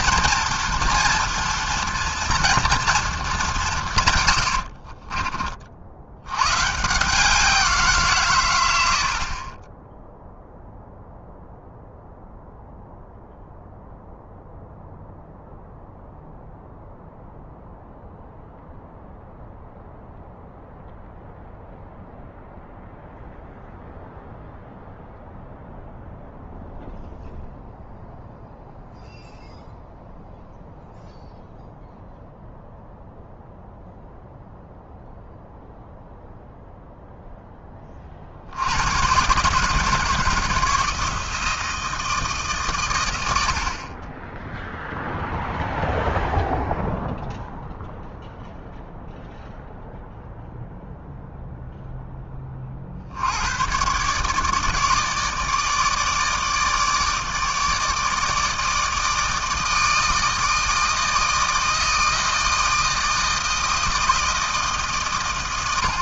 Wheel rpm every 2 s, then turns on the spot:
240, 230, 90, 120, 120, 0, 0, 0, 0, 0, 0, 0, 0, 0, 0, 0, 0, 0, 0, 70, 160, 140, 10, 0, 0, 0, 30, 150, 160, 160, 160, 160, 160.
4-6